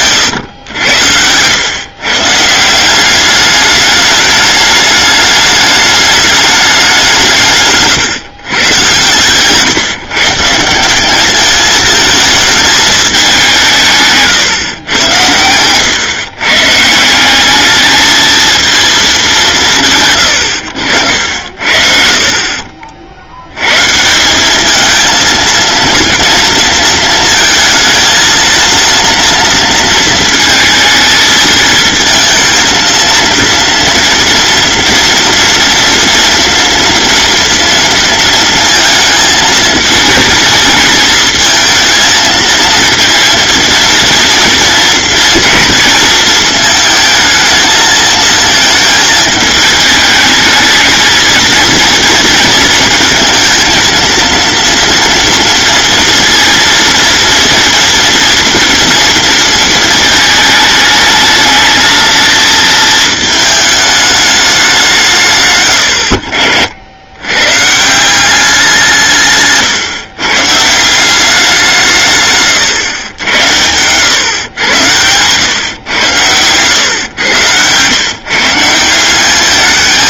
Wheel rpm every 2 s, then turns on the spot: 80, 180, 210, 190, 120, 180, 220, 120, 150, 230, 80, 50, 210, 230, 230, 230, 230, 240, 230, 220, 220, 230, 230, 220, 220, 220, 220, 230, 230, 230, 210, 220, 190, 80, 170, 170, 110, 100, 110, 170.
76-78